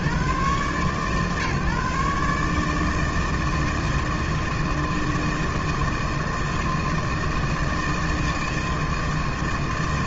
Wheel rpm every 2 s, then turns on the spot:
140, 160, 160, 160, 160.
none